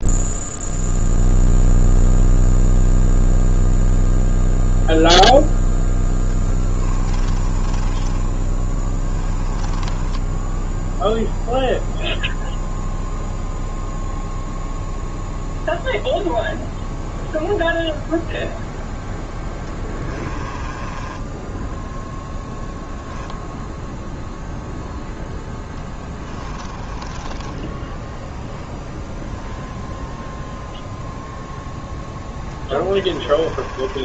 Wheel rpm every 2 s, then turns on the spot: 0, 0, 0, 20, 20, 10, 0, 0, 0, 0, 20, 0, 0, 30, 0, 0, 20.
6-12 20-22 26-28 32-34